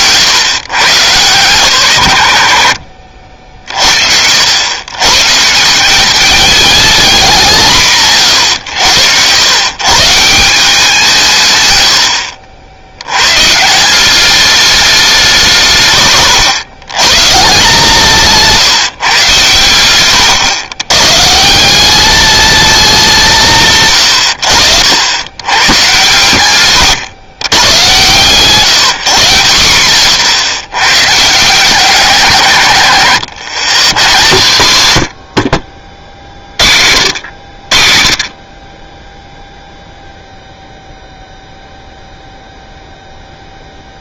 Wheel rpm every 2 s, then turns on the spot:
120, 70, 100, 220, 100, 170, 70, 200, 100, 160, 100, 210, 70, 120, 160, 140, 130, 120, 60, 30, 0, 0.
none